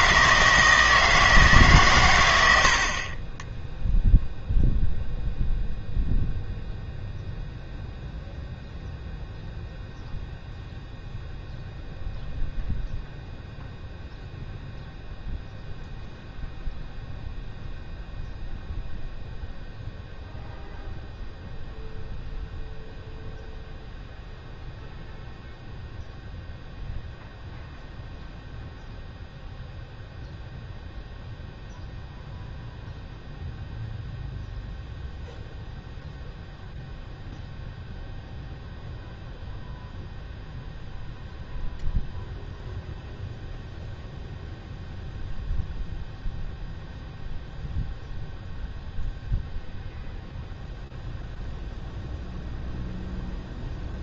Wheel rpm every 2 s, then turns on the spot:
160, 80, 0, 0, 0, 0, 0, 0, 0, 0, 0, 0, 0, 0, 0, 0, 0, 0, 0, 0, 0, 0, 0, 0, 0, 0, 0.
none